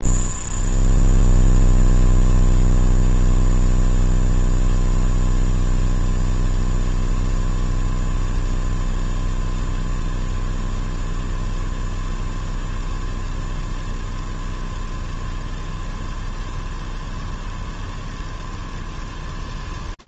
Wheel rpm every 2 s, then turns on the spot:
0, 0, 0, 0, 0, 0, 0, 0, 0, 0.
none